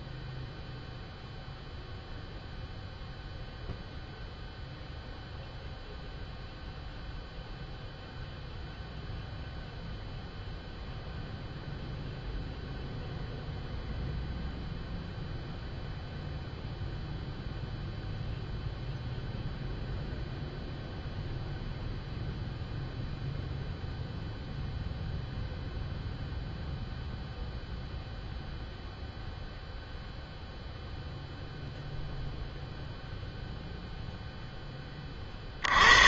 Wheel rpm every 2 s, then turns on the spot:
0, 0, 0, 0, 0, 0, 0, 0, 0, 0, 0, 0, 0, 0, 0, 0, 0, 10.
none